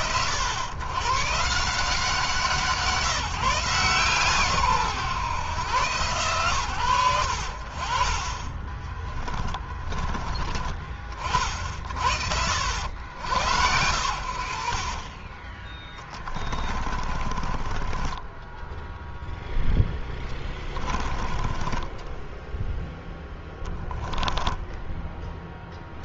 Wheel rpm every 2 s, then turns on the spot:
110, 190, 140, 90, 20, 20, 70, 50, 30, 10, 20, 0, 10.
8-10 16-22 24-26